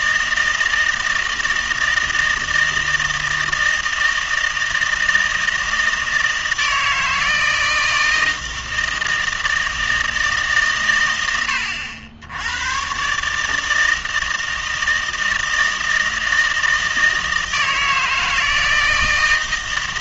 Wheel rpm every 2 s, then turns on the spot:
160, 160, 160, 160, 160, 130, 100, 160, 160, 160.
none